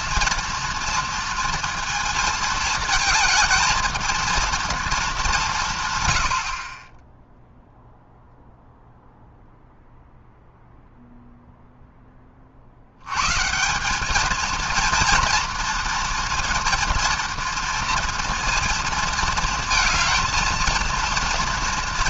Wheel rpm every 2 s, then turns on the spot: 230, 220, 230, 50, 0, 0, 40, 220, 230, 230, 230.
6-8